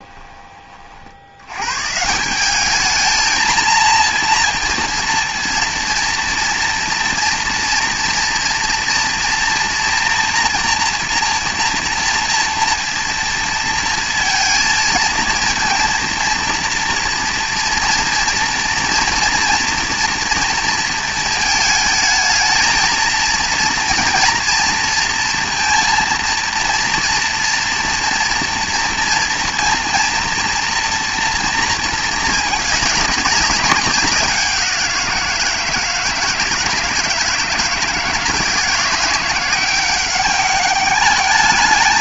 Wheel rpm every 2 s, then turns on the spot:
50, 220, 230, 230, 240, 240, 230, 230, 230, 230, 230, 230, 230, 230, 230, 230, 200, 180, 160, 170, 210.
none